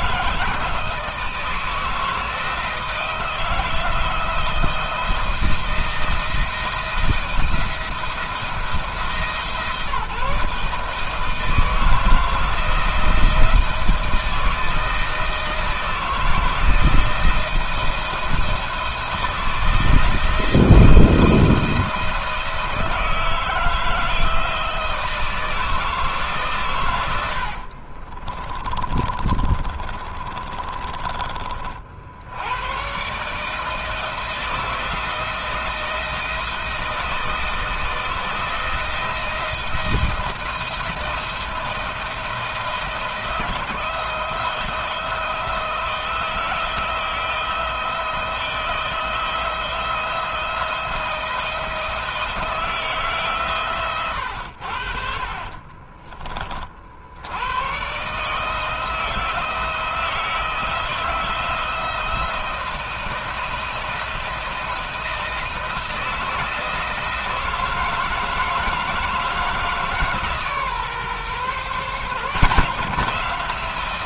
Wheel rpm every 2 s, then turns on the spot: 160, 160, 170, 170, 160, 160, 160, 160, 170, 170, 170, 160, 160, 110, 30, 30, 120, 170, 160, 160, 160, 170, 160, 170, 170, 170, 160, 60, 60, 160, 160, 170, 170, 160, 160, 140, 160.
26-32